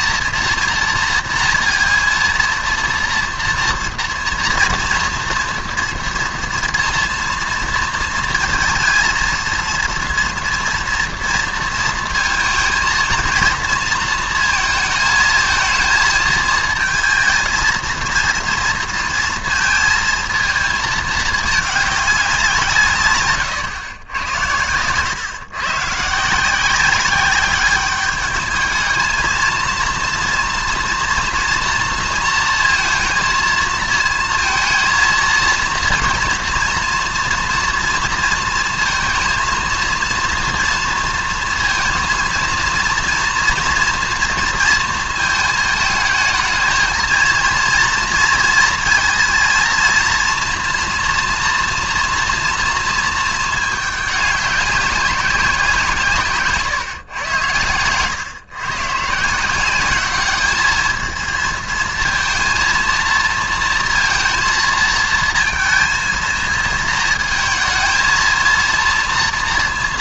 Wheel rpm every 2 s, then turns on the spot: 230, 230, 230, 230, 220, 230, 220, 220, 220, 230, 220, 150, 110, 180, 220, 240, 230, 230, 240, 220, 230, 230, 230, 230, 230, 240, 230, 200, 130, 130, 220, 230, 230, 220, 230.
none